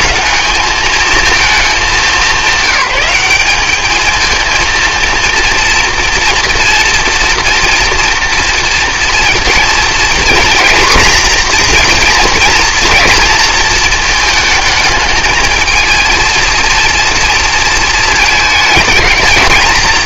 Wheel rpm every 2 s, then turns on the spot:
220, 190, 230, 230, 230, 240, 230, 220, 230, 220.
none